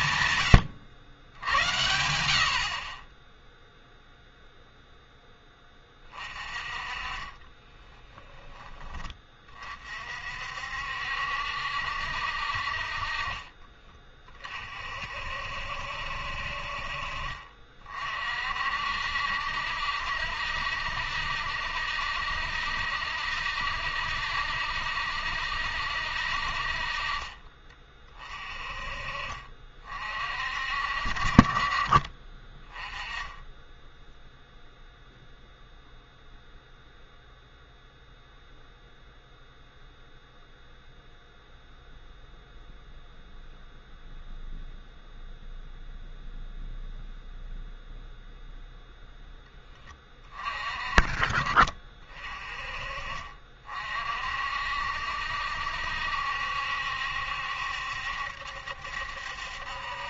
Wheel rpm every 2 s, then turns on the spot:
120, 50, 0, 30, 20, 60, 60, 50, 50, 50, 70, 70, 70, 50, 30, 50, 20, 0, 0, 0, 0, 0, 0, 0, 0, 30, 30, 60, 70, 70.
none